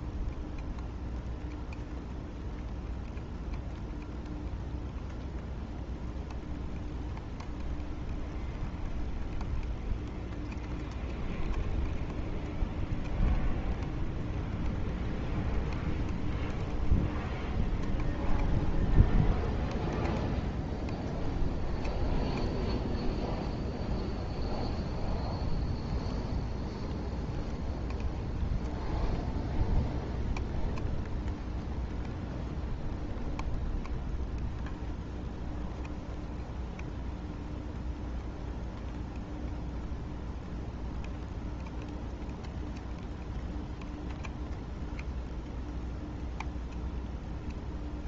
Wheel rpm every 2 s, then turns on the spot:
0, 0, 0, 0, 0, 0, 0, 0, 0, 0, 0, 0, 0, 0, 0, 0, 0, 0, 0, 0, 0, 0, 0, 0.
none